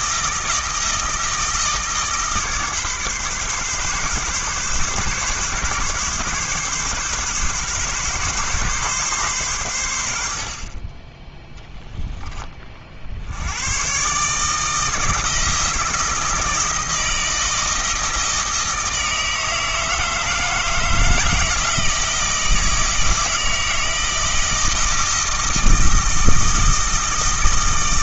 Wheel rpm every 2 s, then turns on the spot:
160, 140, 140, 140, 130, 30, 50, 160, 160, 160, 160, 160, 160, 160.
none